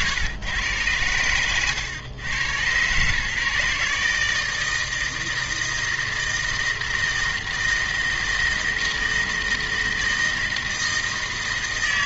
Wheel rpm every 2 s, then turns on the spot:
120, 130, 160, 160, 160, 160.
none